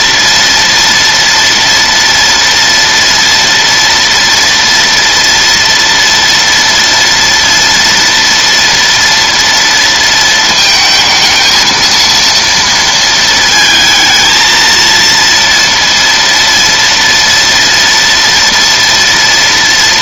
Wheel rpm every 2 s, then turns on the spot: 230, 230, 230, 240, 230, 220, 230, 230, 230, 230.
none